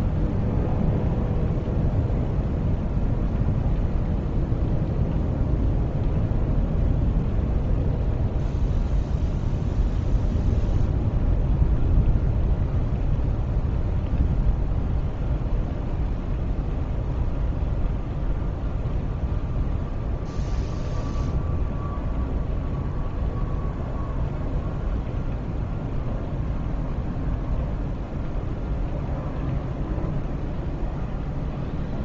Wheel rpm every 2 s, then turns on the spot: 0, 0, 0, 0, 0, 0, 0, 0, 0, 0, 0, 0, 0, 0, 0, 0.
none